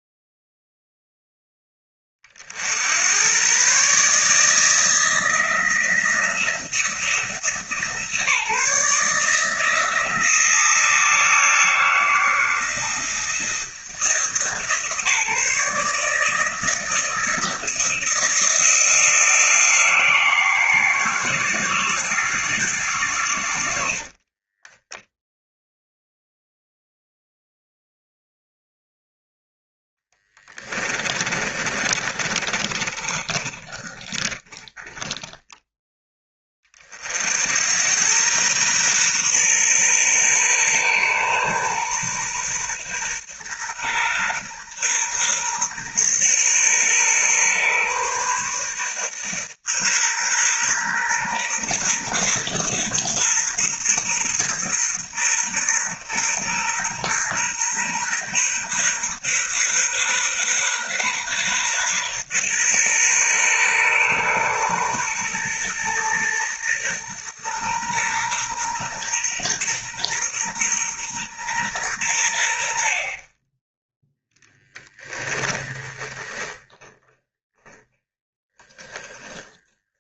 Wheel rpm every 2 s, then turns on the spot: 0, 70, 160, 170, 150, 170, 170, 160, 160, 170, 170, 150, 10, 0, 0, 20, 30, 20, 40, 120, 120, 120, 130, 120, 130, 120, 130, 120, 120, 130, 130, 130, 120, 120, 120, 120, 60, 10, 20, 20.
24-26 30-36 76-80